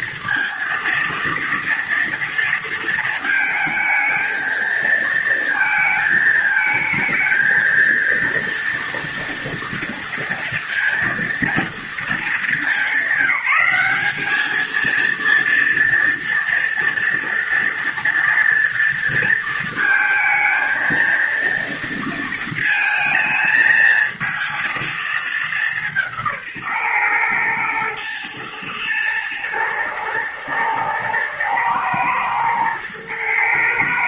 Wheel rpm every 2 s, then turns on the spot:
230, 230, 230, 220, 230, 230, 190, 220, 230, 230, 230, 220, 220, 130, 110, 110, 110.
none